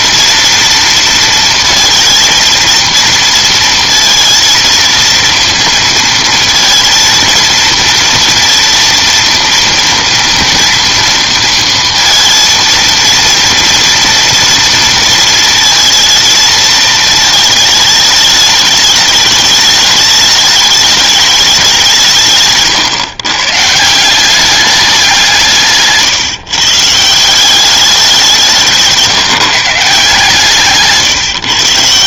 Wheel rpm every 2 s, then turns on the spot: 230, 230, 220, 230, 230, 230, 230, 230, 220, 210, 210, 140, 200, 140, 170, 150.
22-24